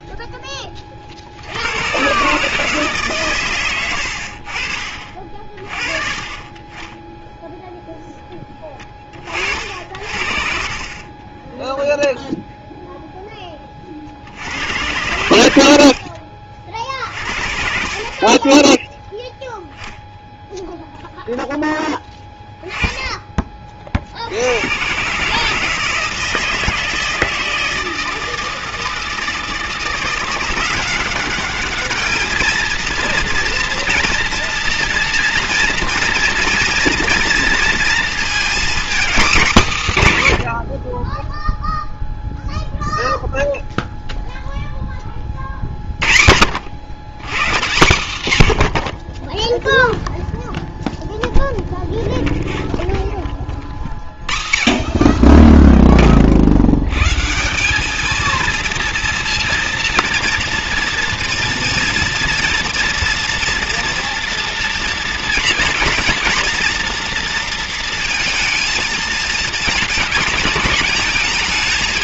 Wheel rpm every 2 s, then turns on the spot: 20, 150, 50, 20, 20, 50, 0, 80, 50, 20, 0, 10, 90, 160, 160, 180, 220, 230, 230, 240, 110, 0, 0, 60, 100, 0, 0, 50, 70, 230, 230, 230, 230, 240, 230, 220.
18-20